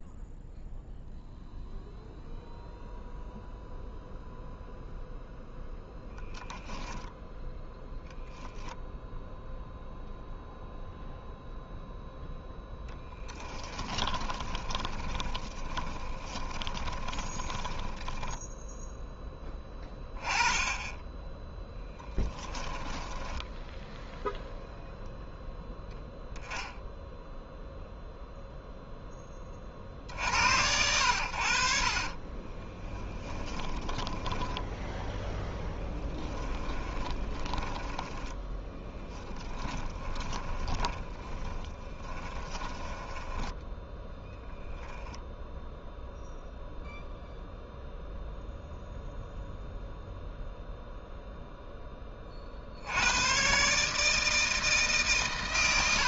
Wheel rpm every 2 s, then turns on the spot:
0, 0, 0, 10, 0, 0, 10, 30, 20, 0, 10, 10, 0, 0, 0, 80, 20, 10, 20, 10, 20, 10, 0, 0, 0, 0, 70, 150.
14-18 22-24 32-34 36-44